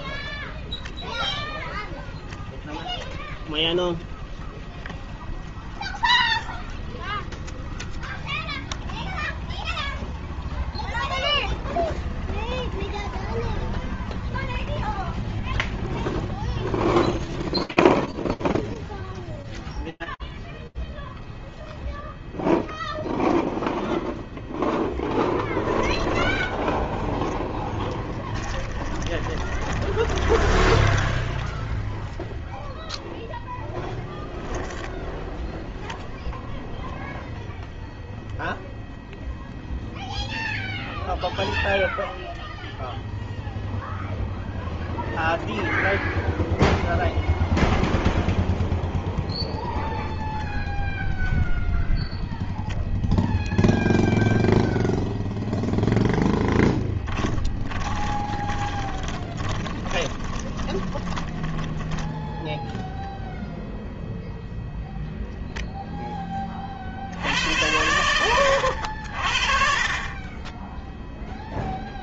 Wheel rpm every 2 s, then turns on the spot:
10, 0, 0, 0, 0, 0, 0, 0, 0, 0, 0, 0, 0, 10, 20, 0, 0, 0, 0, 0, 0, 0, 0, 0, 0, 0, 0, 0, 20, 20, 10, 0, 0, 80, 50, 10.
28-30 56-62